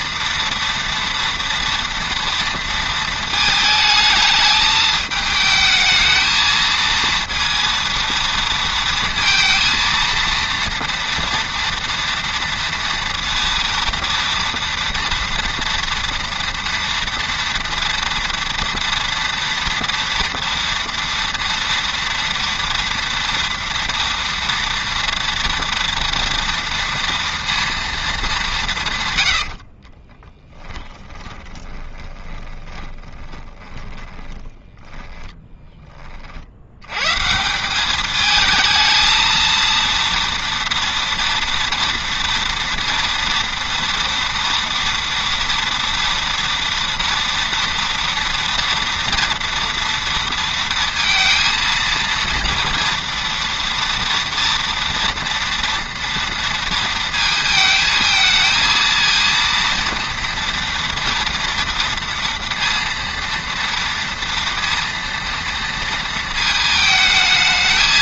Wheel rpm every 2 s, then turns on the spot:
230, 230, 210, 220, 230, 230, 240, 230, 230, 230, 230, 230, 230, 230, 180, 10, 20, 20, 80, 220, 230, 230, 230, 230, 230, 230, 230, 230, 230, 220, 230, 230, 230, 220.
30-36